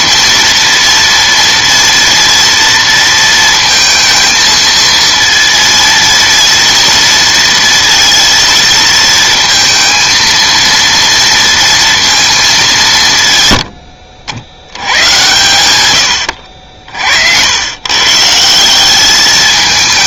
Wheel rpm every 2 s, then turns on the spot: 230, 230, 230, 230, 230, 230, 200, 80, 70, 170.
16-18